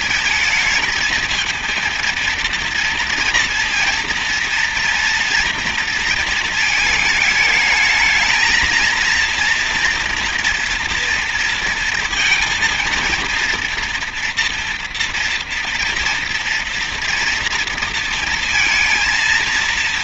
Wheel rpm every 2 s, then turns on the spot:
220, 230, 230, 220, 230, 230, 230, 230, 230, 230.
none